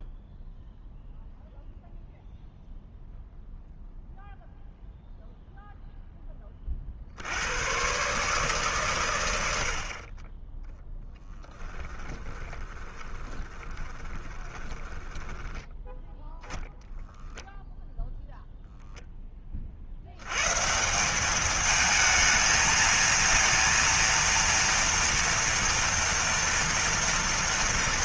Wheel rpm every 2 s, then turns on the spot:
0, 0, 0, 30, 140, 10, 20, 20, 0, 0, 140, 220, 230, 230.
12-16